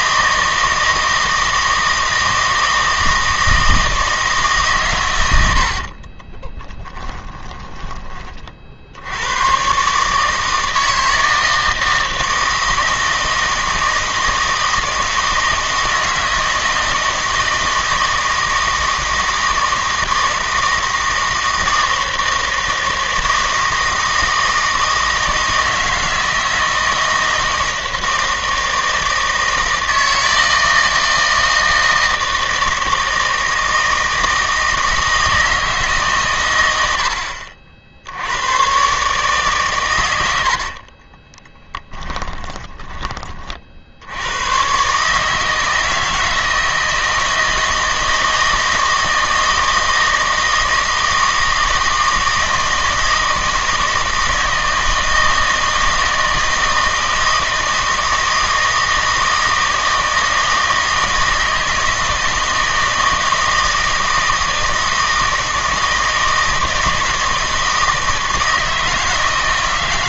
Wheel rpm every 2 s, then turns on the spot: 160, 160, 140, 20, 50, 160, 160, 160, 160, 160, 160, 160, 160, 160, 160, 160, 160, 160, 100, 120, 50, 20, 120, 160, 160, 160, 160, 160, 160, 160, 160, 160, 160, 160, 160.
6-8 40-44